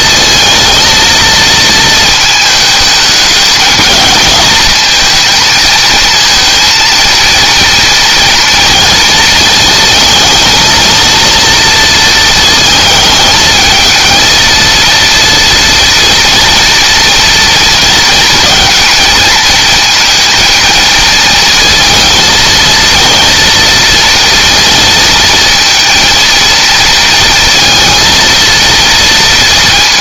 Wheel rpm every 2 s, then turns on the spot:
230, 210, 220, 230, 230, 230, 220, 230, 240, 230, 230, 230, 230, 230, 230.
none